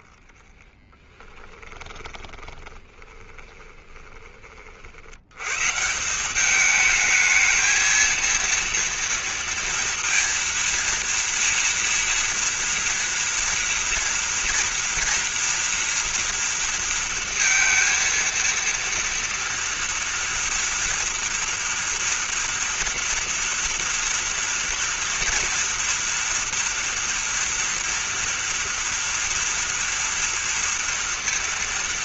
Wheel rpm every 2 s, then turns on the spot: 10, 20, 30, 190, 230, 230, 230, 240, 230, 230, 230, 240, 240, 230, 230, 240.
0-4